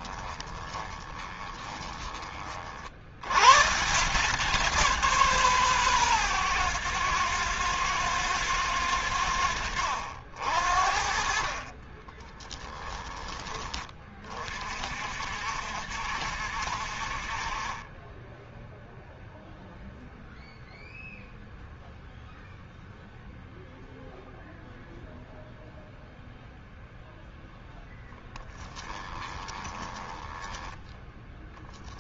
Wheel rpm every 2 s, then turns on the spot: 20, 40, 170, 120, 100, 50, 10, 50, 60, 0, 0, 0, 0, 0, 10, 10.
0-2 28-32